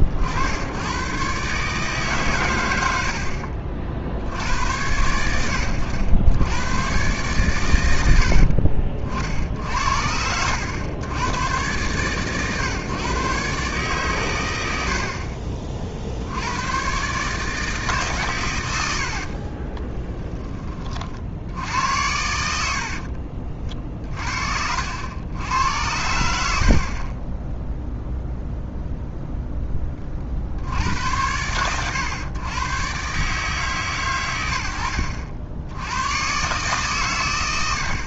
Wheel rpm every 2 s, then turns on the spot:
100, 100, 80, 110, 60, 90, 130, 100, 90, 110, 20, 70, 70, 60, 0, 70, 120, 90, 130.
22-24